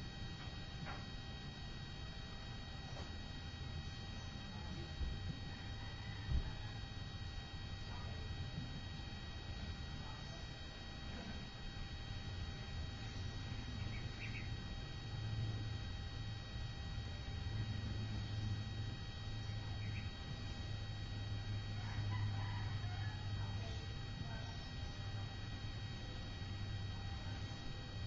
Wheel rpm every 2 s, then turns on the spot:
0, 0, 0, 0, 0, 0, 0, 0, 0, 0, 0, 0, 0, 0.
none